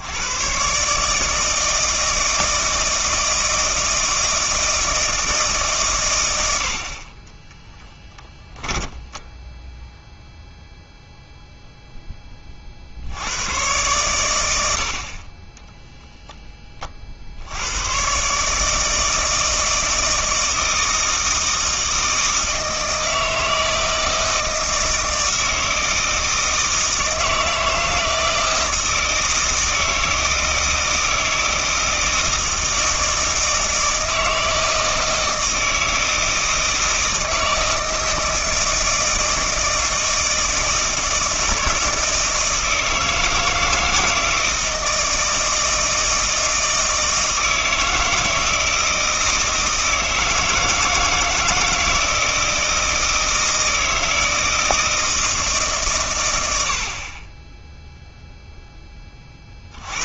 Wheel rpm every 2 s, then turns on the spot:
130, 160, 160, 80, 10, 0, 50, 60, 30, 150, 160, 160, 160, 160, 160, 160, 160, 160, 160, 160, 160, 160, 160, 160, 160, 160, 160, 160, 70, 10.
8-10